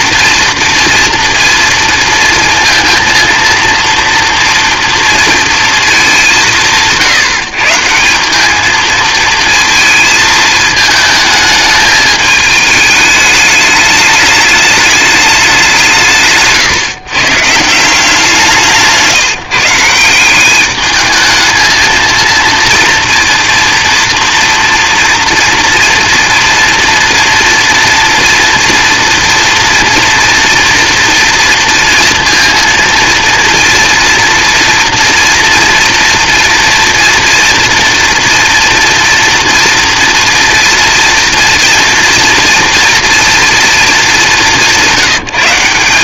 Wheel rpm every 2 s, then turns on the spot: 230, 230, 230, 170, 210, 220, 210, 210, 150, 160, 200, 230, 230, 230, 230, 230, 230, 230, 230, 230, 230, 230, 180.
none